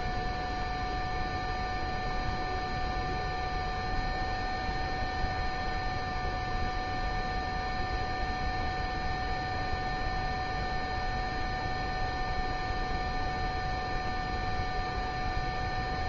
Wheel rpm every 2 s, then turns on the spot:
0, 0, 0, 0, 0, 0, 0, 0.
none